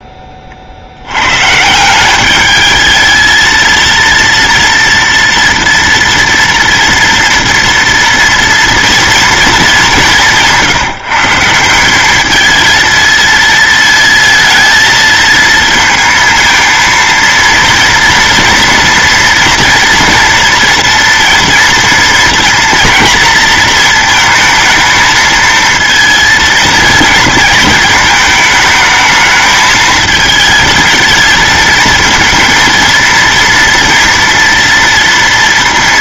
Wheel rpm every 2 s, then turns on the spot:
70, 220, 230, 230, 230, 170, 230, 230, 230, 230, 230, 230, 220, 230, 220, 220, 230, 230.
none